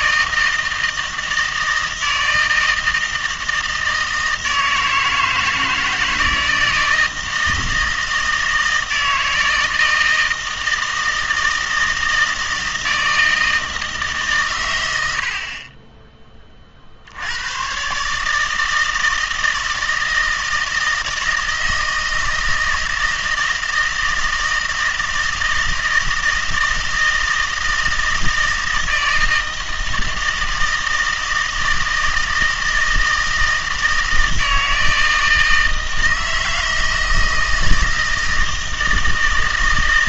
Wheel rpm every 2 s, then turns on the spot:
160, 160, 160, 160, 160, 160, 160, 120, 40, 160, 160, 160, 160, 160, 160, 160, 160, 160, 160, 160.
none